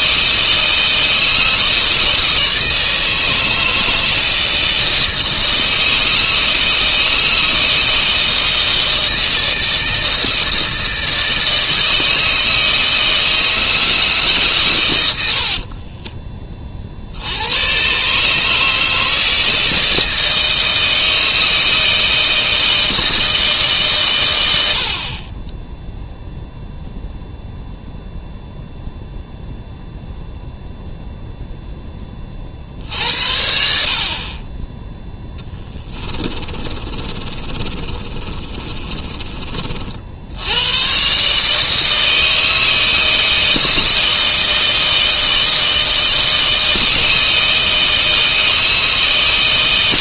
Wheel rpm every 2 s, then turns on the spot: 160, 160, 160, 160, 160, 160, 160, 130, 30, 150, 160, 160, 80, 0, 0, 0, 50, 20, 30, 30, 100, 160, 160, 160, 160.
36-40